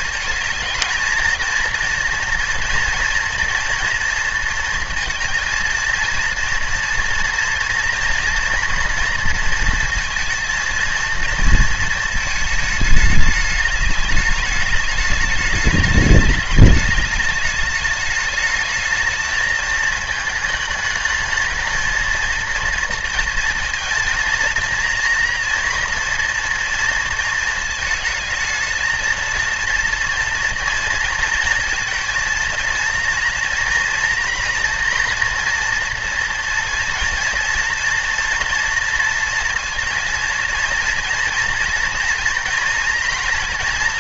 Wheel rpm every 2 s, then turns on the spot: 230, 230, 230, 230, 230, 230, 220, 210, 210, 220, 220, 220, 230, 230, 220, 230, 230, 230, 230, 240, 230, 230.
none